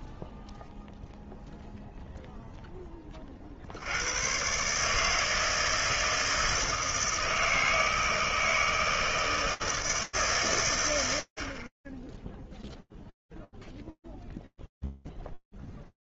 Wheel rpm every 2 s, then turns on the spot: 0, 20, 150, 160, 160, 90, 0, 0.
none